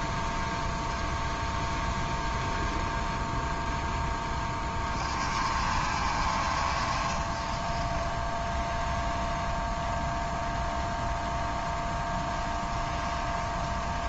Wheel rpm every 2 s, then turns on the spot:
0, 0, 30, 50, 0, 0, 10.
none